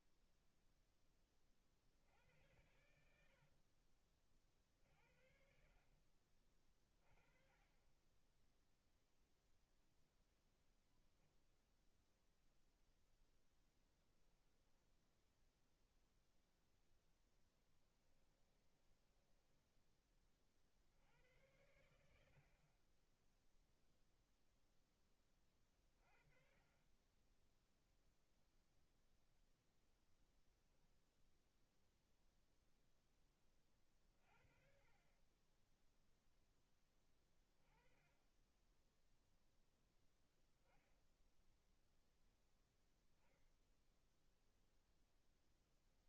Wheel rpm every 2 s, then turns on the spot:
20, 90, 50, 40, 0, 0, 0, 0, 0, 10, 70, 20, 20, 20, 0, 10, 10, 40, 10, 0, 0, 0, 0.
18-20